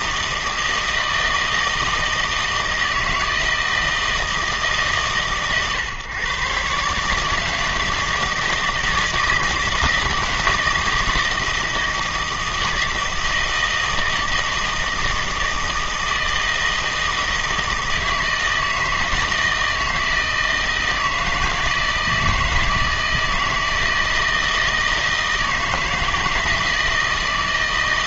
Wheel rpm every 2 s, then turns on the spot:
160, 160, 150, 140, 160, 160, 160, 160, 160, 160, 160, 160, 160, 160.
none